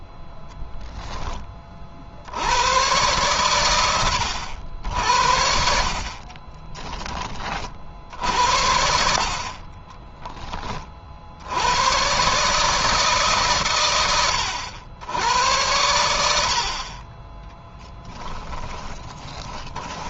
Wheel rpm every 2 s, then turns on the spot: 10, 100, 70, 20, 70, 40, 150, 90, 50, 20.
18-20